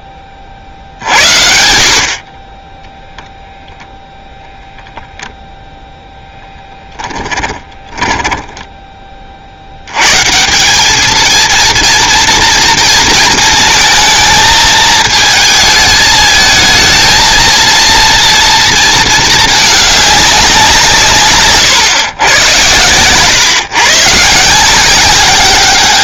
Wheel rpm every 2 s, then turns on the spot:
30, 10, 0, 0, 10, 180, 230, 220, 220, 230, 180, 110, 170.
8-10